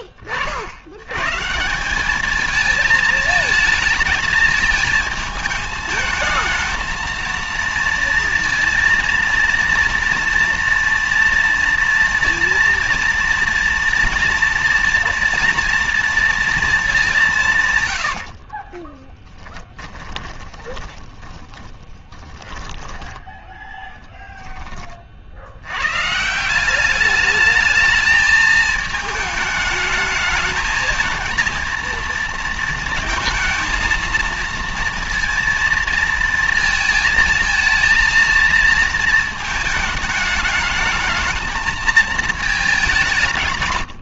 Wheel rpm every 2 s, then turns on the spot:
30, 210, 220, 220, 230, 230, 230, 230, 230, 50, 20, 10, 50, 210, 220, 220, 230, 230, 220, 220, 220, 160.
18-22